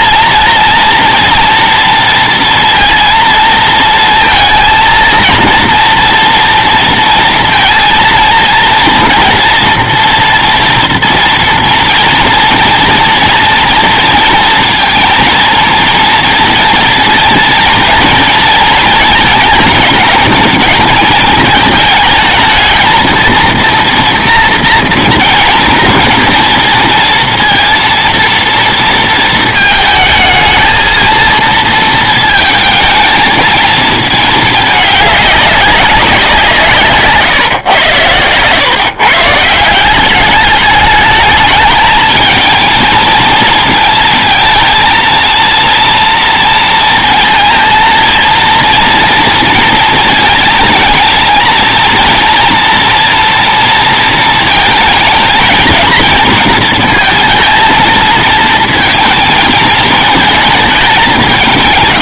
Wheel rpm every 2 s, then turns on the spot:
230, 230, 220, 230, 230, 230, 230, 230, 230, 220, 220, 230, 240, 230, 230, 220, 220, 210, 160, 120, 210, 220, 220, 230, 230, 230, 230, 220, 230, 220, 220.
none